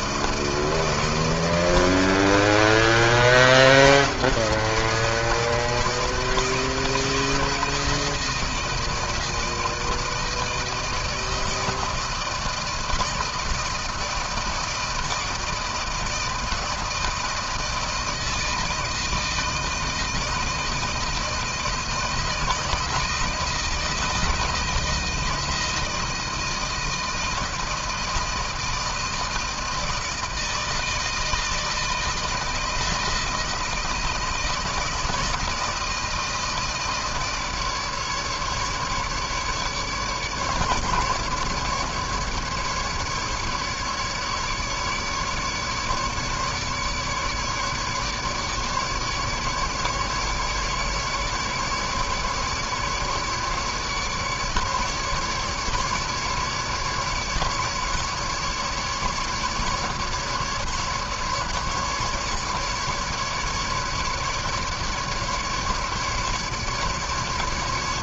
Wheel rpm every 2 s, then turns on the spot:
160, 160, 170, 160, 160, 160, 160, 160, 160, 160, 160, 160, 170, 160, 160, 160, 160, 160, 160, 150, 150, 150, 150, 150, 150, 150, 150, 150, 150, 150, 150, 150, 150, 150.
none